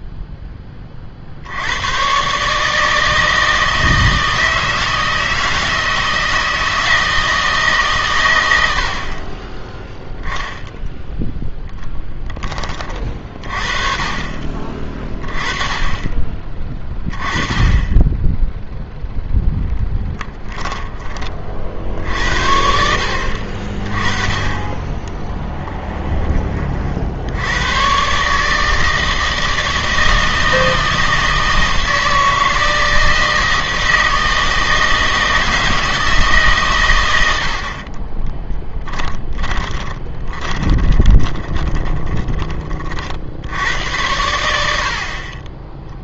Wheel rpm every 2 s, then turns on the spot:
10, 150, 160, 160, 90, 0, 30, 30, 20, 0, 10, 60, 20, 30, 160, 160, 160, 160, 130, 20, 20, 30, 70.
38-42